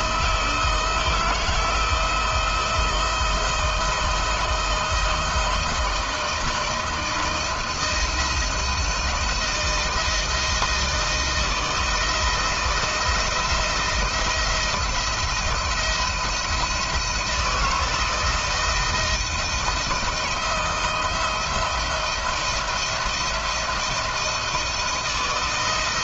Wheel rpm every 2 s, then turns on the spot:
170, 160, 170, 170, 170, 170, 160, 170, 170, 160, 160, 170, 160.
none